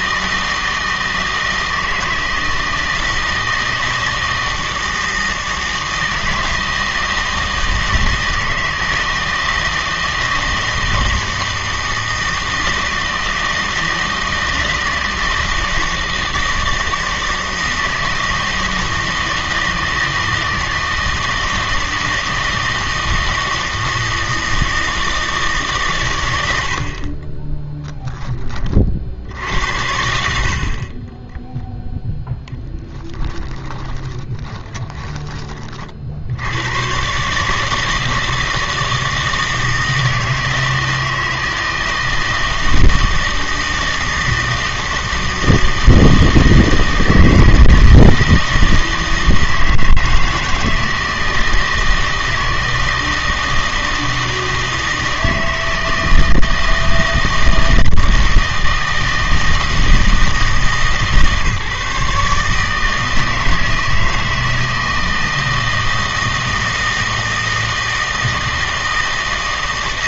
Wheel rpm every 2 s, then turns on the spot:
160, 160, 160, 160, 160, 160, 160, 160, 160, 160, 160, 160, 160, 70, 30, 40, 10, 10, 100, 160, 160, 160, 160, 160, 160, 160, 160, 160, 160, 160, 150, 160, 160, 160, 160.
32-36